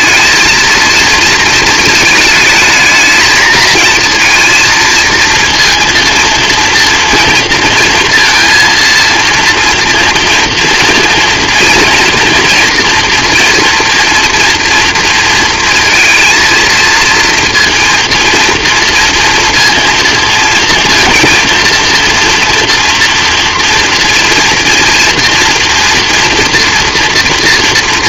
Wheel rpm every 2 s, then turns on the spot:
230, 220, 230, 230, 230, 230, 230, 230, 230, 230, 230, 230, 230, 240.
none